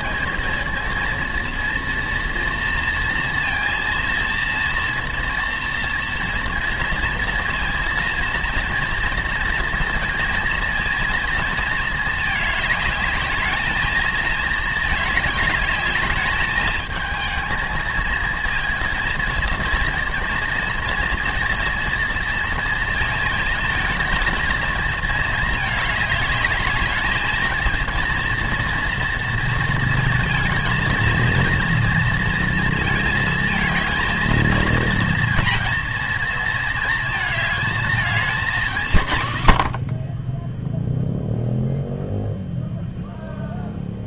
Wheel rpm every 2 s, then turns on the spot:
230, 230, 230, 230, 230, 230, 210, 210, 220, 230, 230, 220, 220, 220, 230, 230, 220, 230, 220, 150, 0, 0.
none